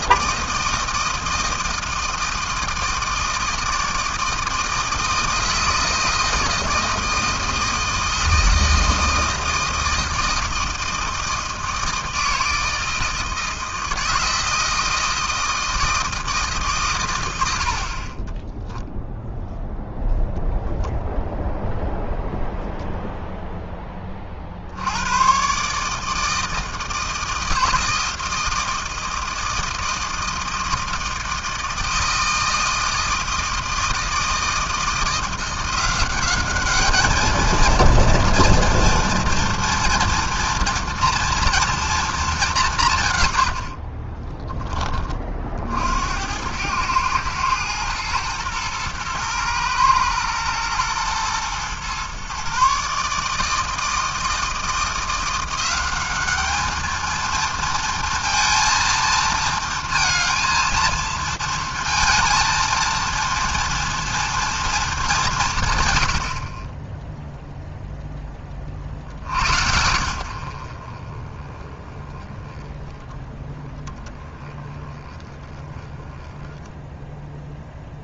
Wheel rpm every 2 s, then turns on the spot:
160, 160, 160, 160, 160, 160, 160, 160, 150, 10, 0, 0, 50, 160, 160, 160, 160, 160, 200, 230, 230, 210, 20, 90, 120, 110, 130, 160, 210, 230, 230, 230, 230, 40, 30, 70, 20, 10, 10.
18-20